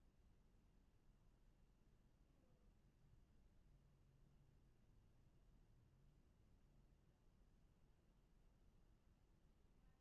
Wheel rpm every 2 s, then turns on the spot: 0, 0, 0, 0, 0.
none